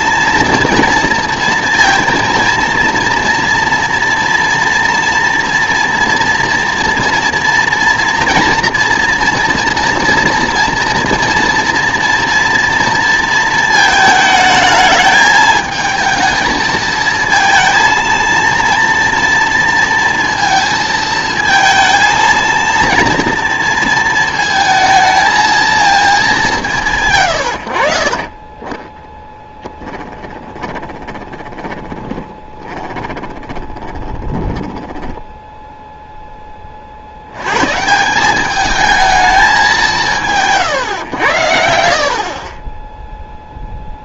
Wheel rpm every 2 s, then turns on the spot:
230, 230, 240, 230, 240, 230, 230, 220, 220, 230, 220, 230, 220, 180, 30, 20, 20, 10, 30, 210, 150, 20.
30-36